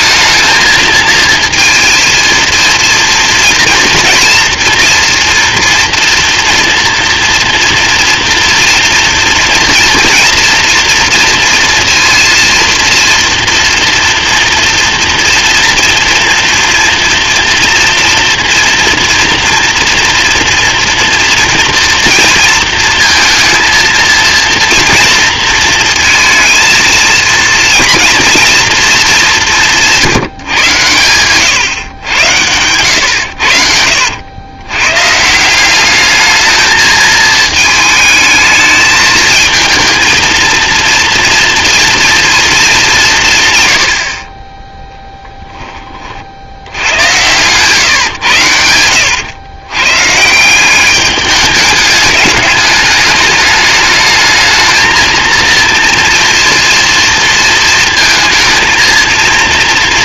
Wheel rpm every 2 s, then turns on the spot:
220, 230, 230, 230, 230, 230, 230, 230, 240, 240, 230, 230, 240, 230, 230, 120, 100, 120, 220, 220, 230, 200, 10, 80, 90, 180, 210, 220, 230, 230.
none